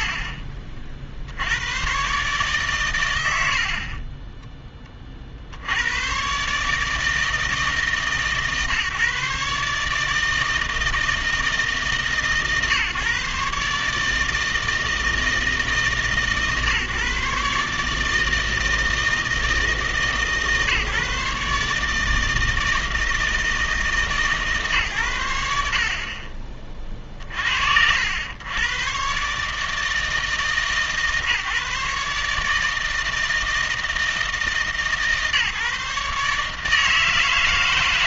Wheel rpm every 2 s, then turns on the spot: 60, 110, 20, 140, 150, 160, 140, 160, 150, 160, 150, 160, 130, 30, 110, 150, 160, 150, 150.
2-4